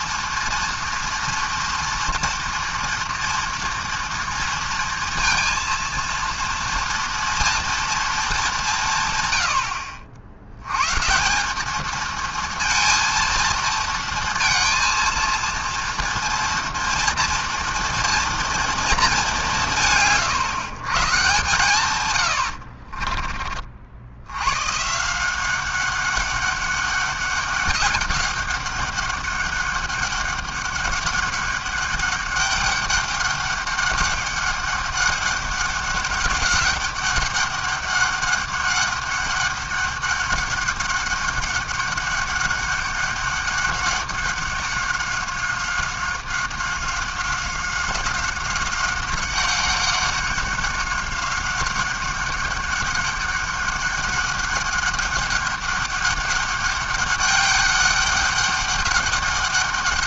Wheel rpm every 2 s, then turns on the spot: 240, 240, 230, 240, 110, 180, 230, 230, 230, 200, 130, 30, 180, 200, 200, 200, 200, 200, 200, 200, 200, 200, 190, 190, 190, 200, 200, 200, 200, 200.
22-24